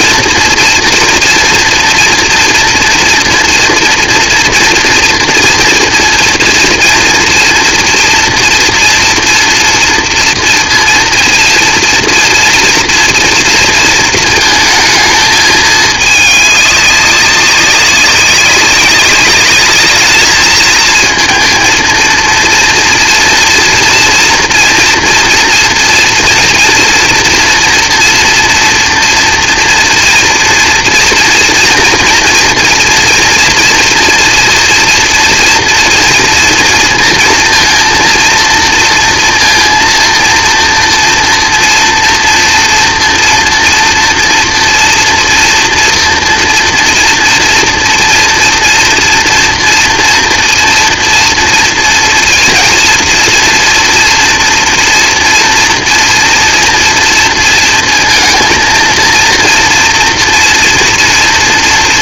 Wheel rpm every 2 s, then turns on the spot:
230, 230, 230, 240, 230, 230, 230, 220, 210, 200, 220, 230, 230, 230, 240, 230, 230, 230, 230, 230, 230, 230, 230, 230, 230, 230, 230, 230, 230, 230, 240.
none